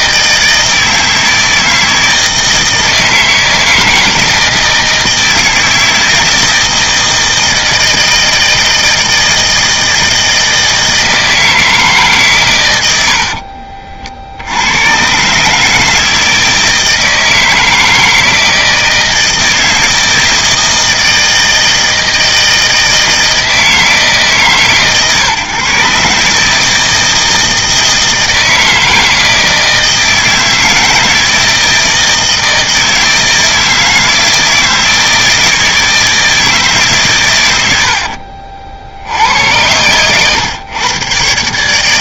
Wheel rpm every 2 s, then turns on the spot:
160, 160, 160, 160, 160, 160, 110, 100, 160, 160, 160, 160, 140, 160, 160, 160, 160, 160, 140, 70, 120.
none